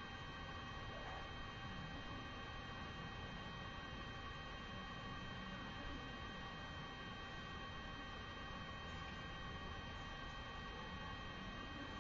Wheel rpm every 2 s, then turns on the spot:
0, 0, 0, 0, 0, 0.
none